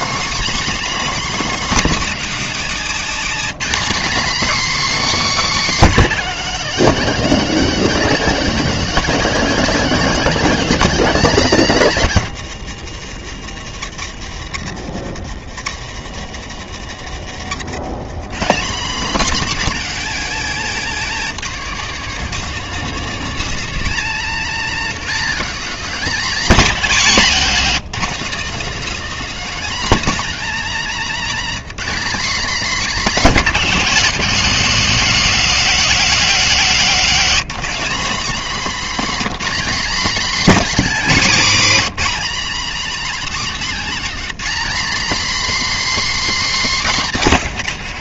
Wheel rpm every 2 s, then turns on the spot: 130, 280, 270, 290, 260, 270, 260, 160, 150, 140, 230, 210, 230, 260, 210, 280, 230, 200, 190, 230, 260, 260, 270, 310.
18-20 22-24